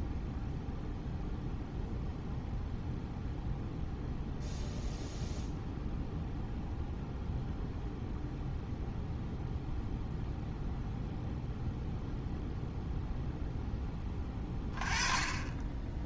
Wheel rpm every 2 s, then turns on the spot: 0, 0, 0, 0, 0, 0, 0, 20.
none